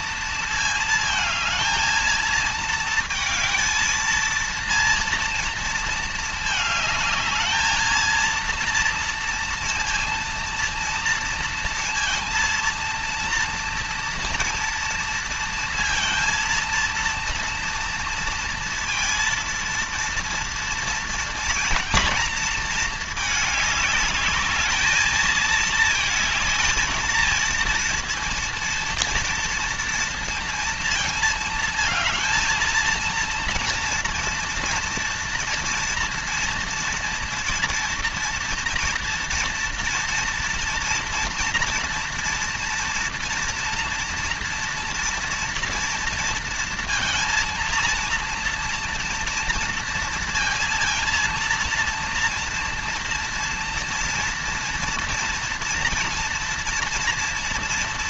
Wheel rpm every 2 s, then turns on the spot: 220, 220, 230, 210, 230, 230, 230, 230, 230, 230, 230, 220, 220, 230, 230, 220, 230, 230, 230, 230, 230, 230, 230, 230, 230, 230, 230, 230, 240.
none